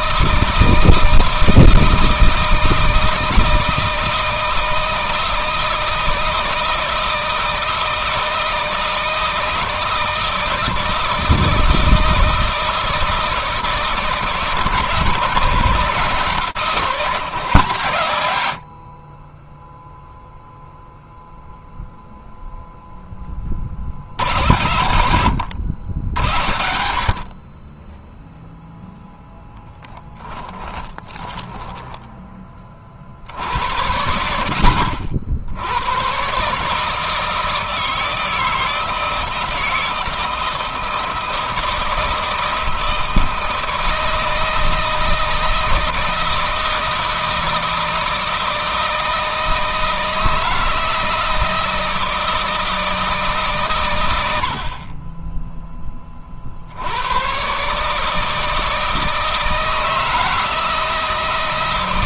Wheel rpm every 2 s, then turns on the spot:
160, 160, 160, 160, 160, 160, 160, 150, 160, 50, 0, 0, 90, 50, 0, 20, 50, 60, 150, 160, 170, 160, 160, 160, 160, 160, 160, 30, 90, 160, 160.
30-32